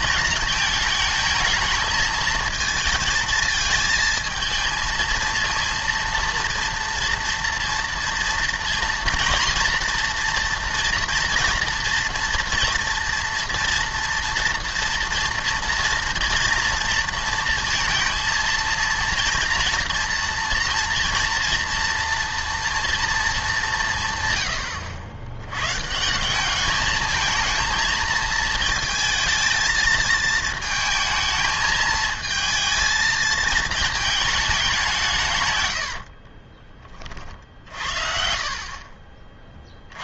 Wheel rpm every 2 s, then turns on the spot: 210, 220, 220, 230, 230, 230, 240, 230, 230, 230, 230, 230, 110, 210, 230, 230, 220, 190, 30, 40.
none